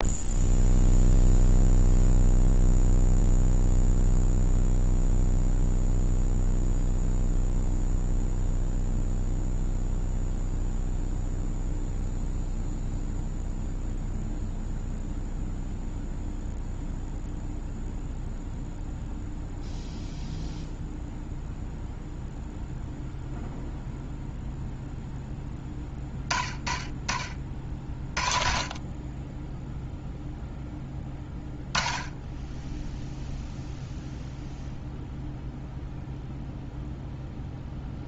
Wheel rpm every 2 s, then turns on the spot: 0, 0, 0, 0, 0, 0, 0, 0, 0, 0, 0, 0, 0, 30, 30, 10, 10, 0, 0.
32-34